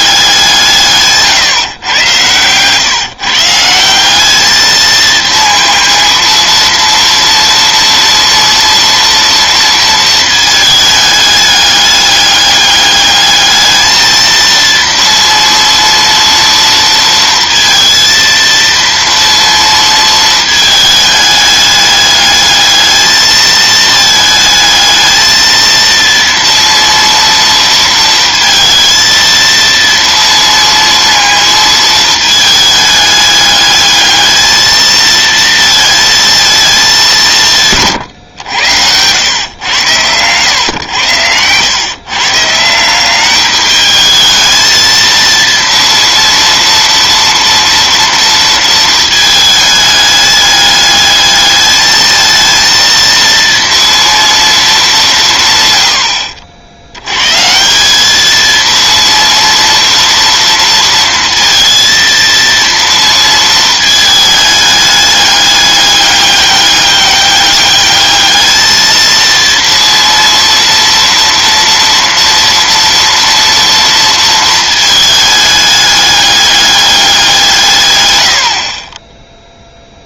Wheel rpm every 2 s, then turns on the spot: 170, 120, 220, 230, 230, 220, 210, 230, 230, 230, 220, 220, 220, 230, 230, 230, 210, 220, 220, 100, 110, 160, 220, 230, 230, 210, 230, 220, 70, 230, 230, 230, 210, 200, 220, 230, 230, 220, 200, 50.
none